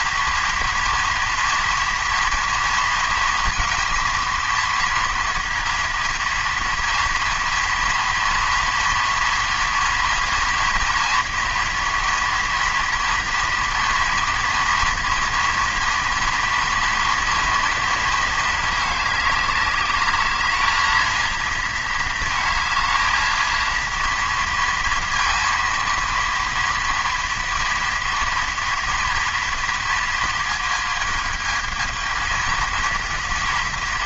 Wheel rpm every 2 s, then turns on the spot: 230, 230, 230, 230, 230, 230, 230, 230, 230, 210, 220, 220, 230, 230, 230, 220, 230.
none